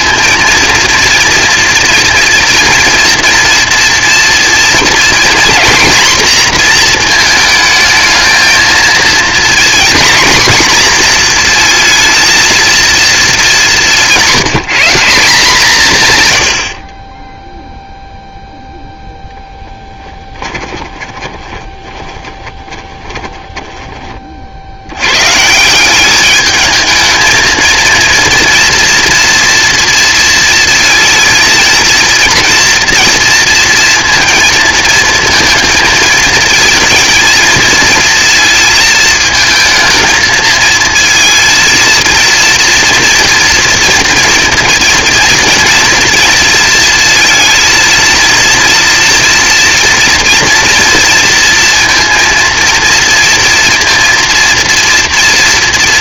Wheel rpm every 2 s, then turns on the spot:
230, 230, 240, 240, 230, 240, 230, 180, 80, 0, 20, 20, 70, 220, 230, 230, 230, 230, 220, 230, 220, 230, 230, 230, 230, 240, 230, 230.
16-18 20-24